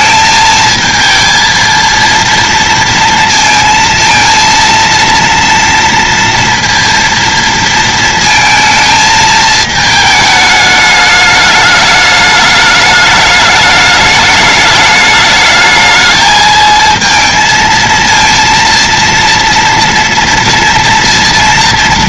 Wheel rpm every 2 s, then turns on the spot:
220, 230, 230, 230, 220, 210, 210, 210, 220, 230, 230.
none